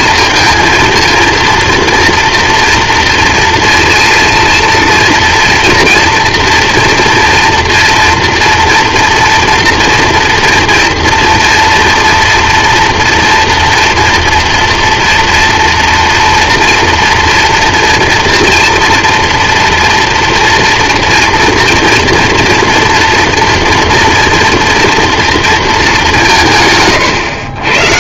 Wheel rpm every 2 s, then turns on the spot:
230, 230, 230, 230, 230, 230, 230, 230, 230, 230, 230, 240, 230, 160.
none